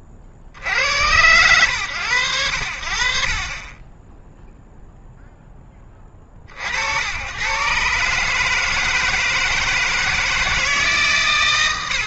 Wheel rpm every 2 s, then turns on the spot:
70, 100, 0, 70, 160, 150.
none